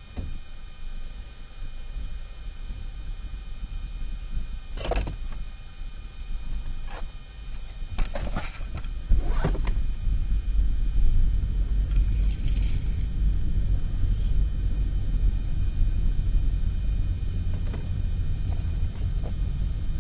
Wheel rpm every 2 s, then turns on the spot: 0, 0, 0, 0, 0, 0, 0, 0, 0, 0.
none